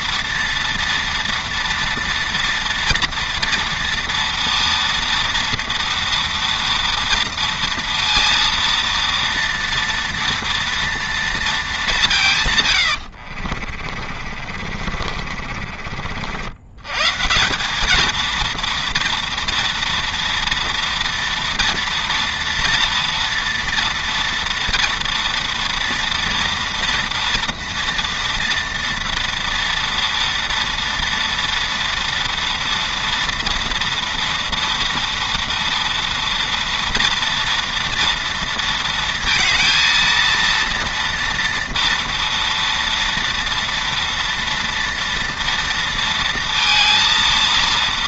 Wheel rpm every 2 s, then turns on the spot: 230, 230, 230, 230, 230, 230, 80, 40, 160, 230, 230, 230, 230, 230, 230, 230, 230, 230, 230, 230, 230, 230, 230, 230.
12-16